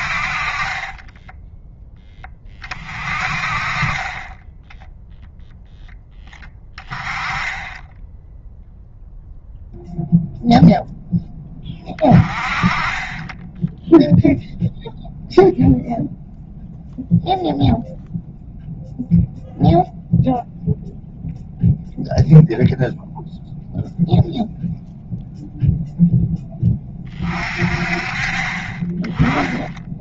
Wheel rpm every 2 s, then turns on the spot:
30, 20, 10, 20, 0, 0, 20, 0, 0, 0, 0, 0, 0, 10, 20.
0-2